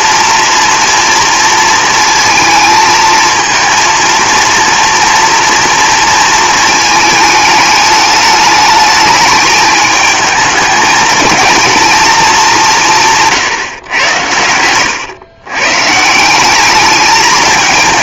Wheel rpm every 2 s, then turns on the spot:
230, 220, 230, 220, 210, 210, 180, 100, 200.
14-16